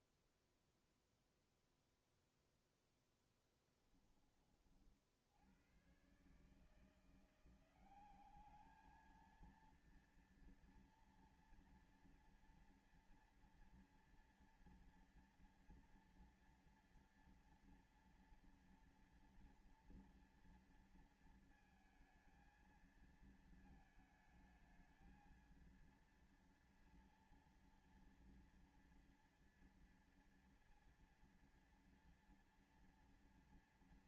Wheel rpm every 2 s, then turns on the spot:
0, 0, 20, 130, 190, 230, 230, 230, 230, 230, 230, 220, 220, 230, 230, 230, 230.
none